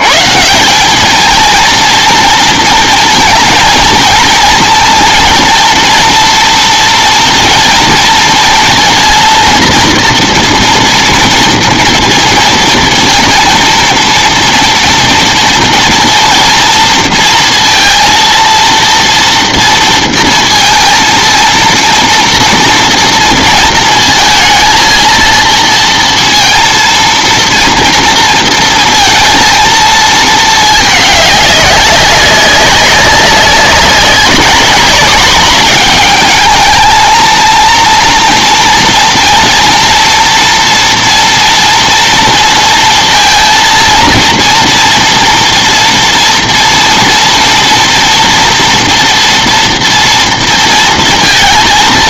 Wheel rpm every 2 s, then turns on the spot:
160, 230, 230, 230, 230, 240, 230, 230, 230, 230, 230, 230, 230, 230, 230, 220, 190, 200, 220, 230, 230, 230, 230, 230, 230, 230.
none